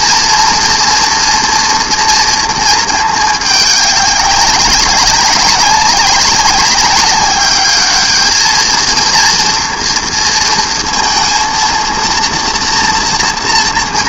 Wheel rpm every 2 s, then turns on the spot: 240, 230, 190, 200, 220, 230, 230.
none